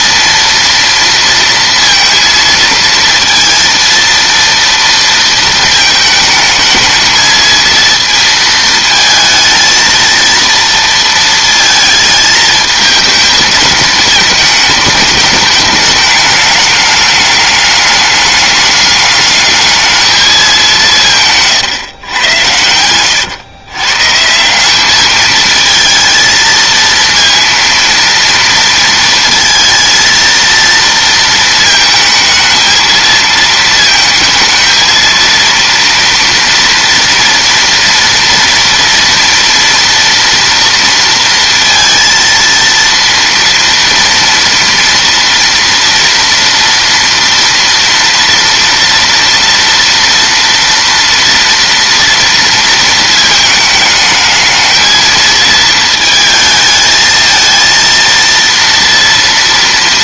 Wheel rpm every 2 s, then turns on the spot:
230, 230, 230, 220, 230, 230, 220, 210, 210, 200, 200, 90, 190, 230, 230, 230, 220, 220, 230, 230, 230, 230, 230, 230, 230, 230, 230, 220, 220, 230.
none